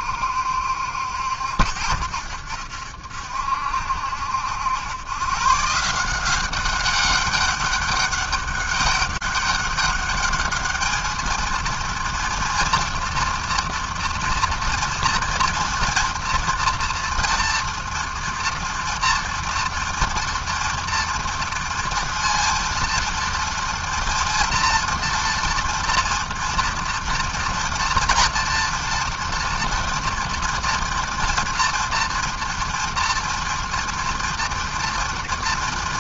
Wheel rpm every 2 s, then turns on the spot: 70, 70, 80, 190, 200, 210, 230, 230, 230, 230, 230, 230, 230, 230, 230, 230, 230, 230.
none